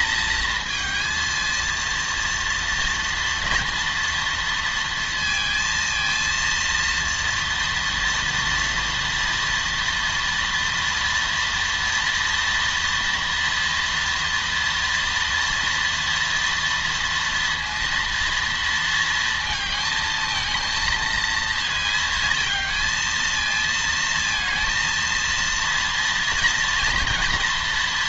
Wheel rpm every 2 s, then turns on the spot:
230, 230, 230, 230, 230, 230, 230, 230, 230, 230, 230, 220, 230, 230.
none